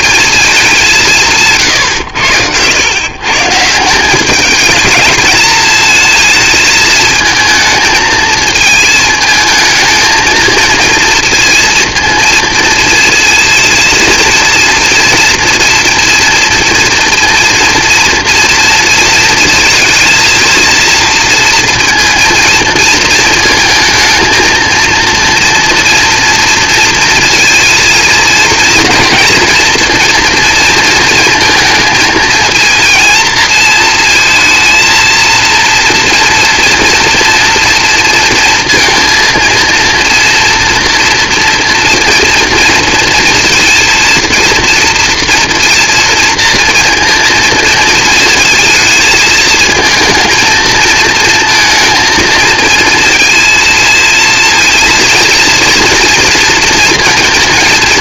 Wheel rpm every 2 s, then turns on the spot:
180, 110, 210, 220, 220, 230, 230, 230, 230, 230, 230, 230, 230, 230, 230, 220, 230, 220, 230, 230, 230, 230, 230, 230, 220, 220, 230, 230, 230.
none